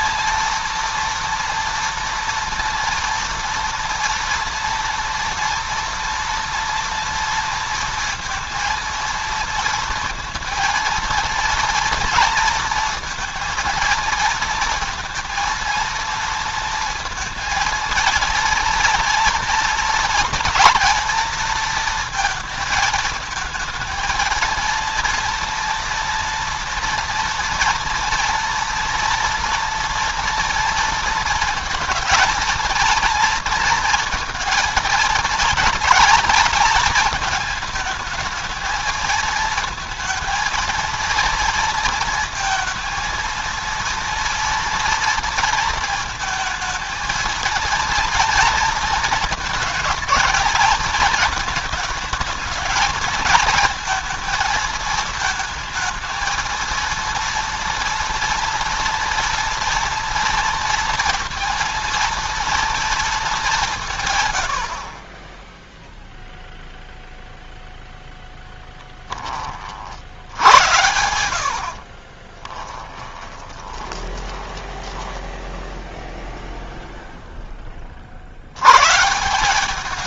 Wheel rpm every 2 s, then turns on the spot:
230, 230, 240, 230, 230, 230, 230, 230, 230, 230, 240, 220, 230, 230, 230, 230, 230, 230, 230, 220, 230, 220, 230, 230, 230, 220, 220, 220, 230, 230, 230, 230, 70, 0, 10, 90, 20, 10, 0, 120.
70-76